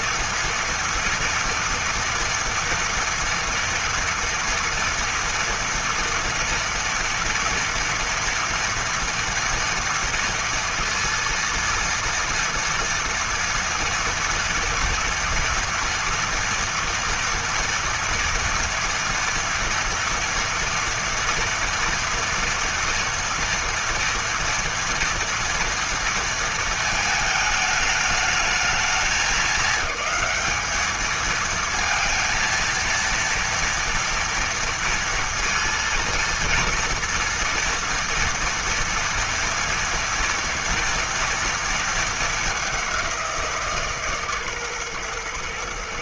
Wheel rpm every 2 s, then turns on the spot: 230, 240, 230, 230, 230, 230, 230, 230, 230, 230, 230, 240, 230, 230, 210, 210, 230, 230, 230, 230, 230, 210, 140.
none